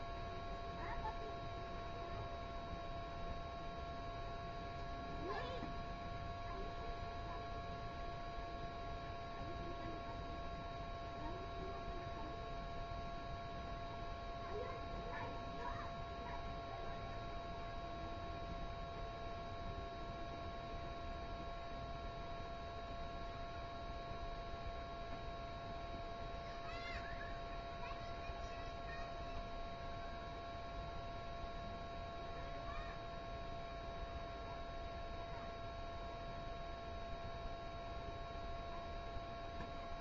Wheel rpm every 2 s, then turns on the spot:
0, 0, 0, 0, 0, 0, 0, 0, 0, 0, 0, 0, 0, 0, 0, 0, 0, 0, 0, 0.
none